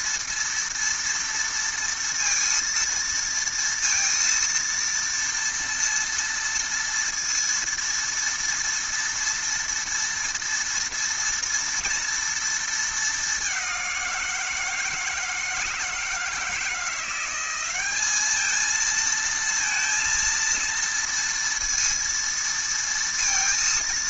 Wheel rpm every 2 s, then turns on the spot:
230, 230, 230, 230, 230, 230, 230, 170, 160, 210, 230, 230.
none